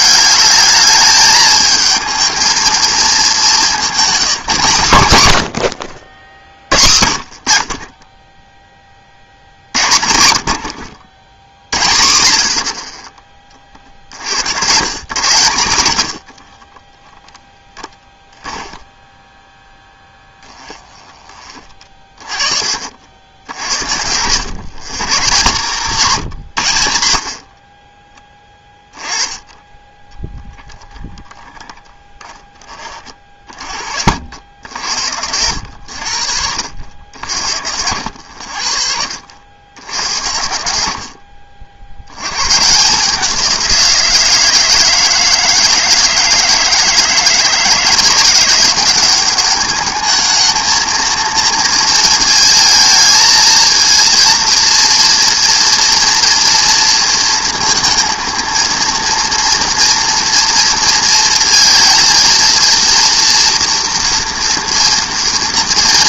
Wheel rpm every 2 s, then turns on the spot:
210, 220, 180, 50, 0, 70, 60, 100, 30, 10, 10, 40, 110, 110, 10, 10, 10, 60, 70, 70, 70, 130, 160, 160, 180, 220, 230, 230, 230, 230, 230, 230, 240.
16-22